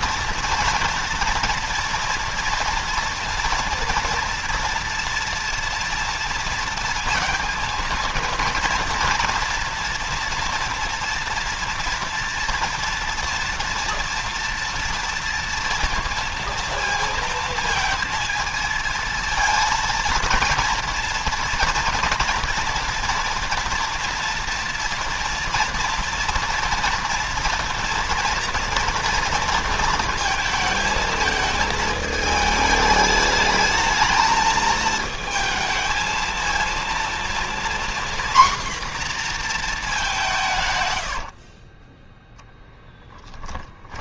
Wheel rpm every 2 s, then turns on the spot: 230, 230, 230, 230, 230, 230, 230, 230, 230, 230, 230, 230, 230, 230, 240, 220, 220, 220, 230, 240, 160, 10.
none